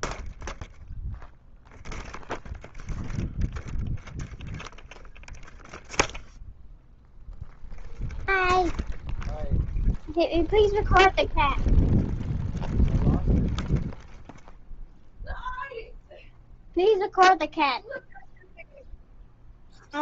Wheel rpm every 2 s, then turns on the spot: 0, 0, 0, 0, 0, 0, 0, 0, 0, 0.
none